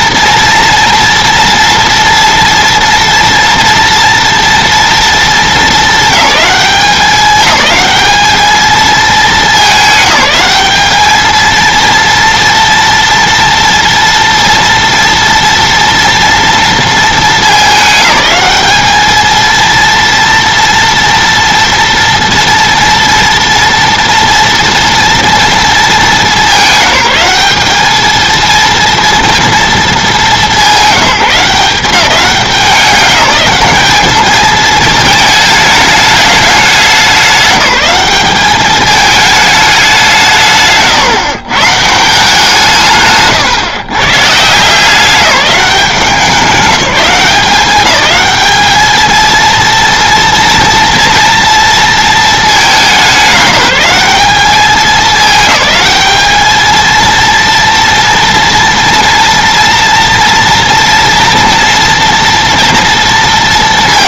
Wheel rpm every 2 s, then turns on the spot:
230, 230, 230, 210, 220, 200, 240, 240, 230, 210, 230, 230, 230, 190, 230, 210, 200, 220, 200, 200, 160, 170, 160, 180, 210, 240, 210, 200, 220, 230, 230, 230.
none